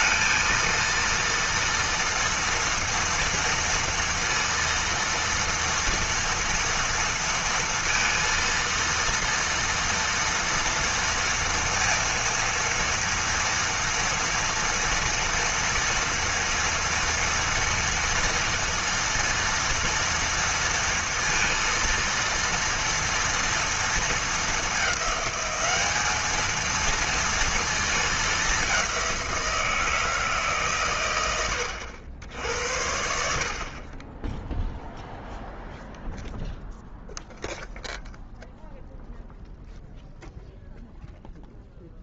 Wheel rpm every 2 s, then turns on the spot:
230, 230, 230, 230, 230, 230, 230, 240, 240, 230, 230, 230, 210, 230, 190, 120, 70, 0, 0, 0, 0.
none